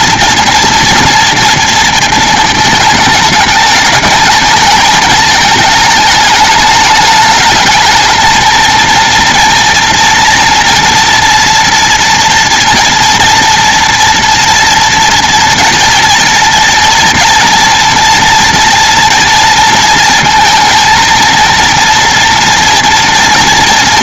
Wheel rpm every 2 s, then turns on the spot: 230, 220, 210, 210, 230, 230, 230, 240, 230, 230, 230, 230.
none